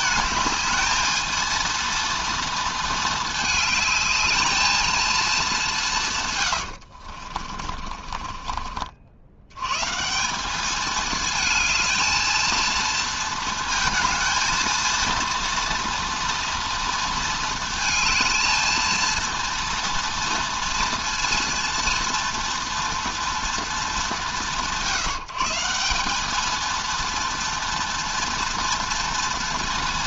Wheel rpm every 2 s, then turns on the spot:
210, 220, 220, 90, 40, 210, 230, 220, 230, 220, 230, 240, 160, 220, 230.
6-8